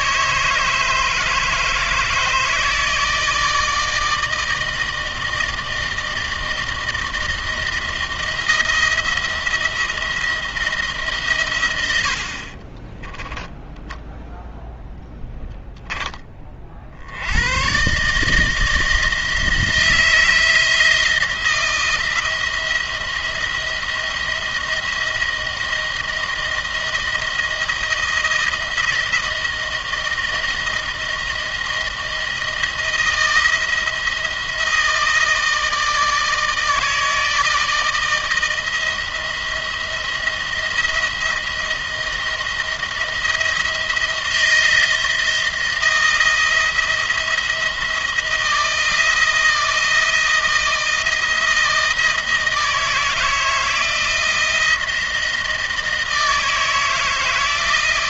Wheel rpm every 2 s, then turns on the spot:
150, 160, 160, 160, 170, 160, 40, 0, 40, 160, 160, 170, 170, 160, 160, 160, 160, 160, 160, 160, 170, 170, 170, 170, 170, 170, 160, 170, 160.
12-14